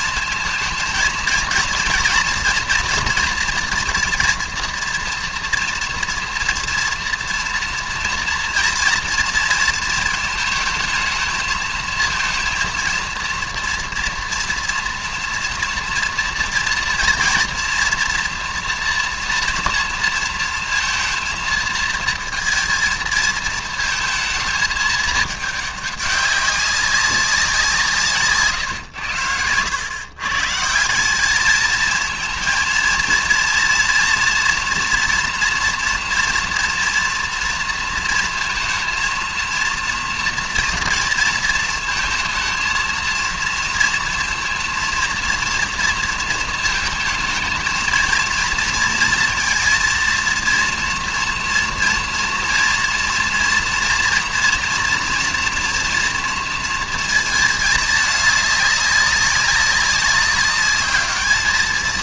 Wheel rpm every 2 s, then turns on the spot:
230, 230, 230, 230, 230, 220, 230, 230, 230, 230, 230, 230, 220, 200, 130, 160, 230, 230, 230, 230, 230, 230, 230, 220, 230, 230, 230, 230, 230, 200, 200.
none